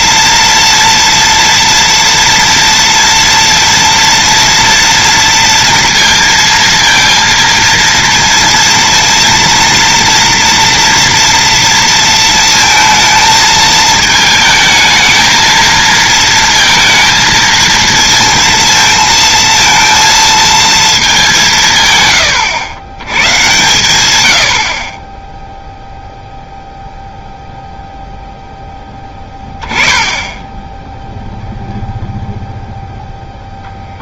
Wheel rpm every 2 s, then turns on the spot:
230, 230, 230, 230, 230, 230, 230, 220, 230, 230, 220, 100, 50, 0, 10, 10, 0.
none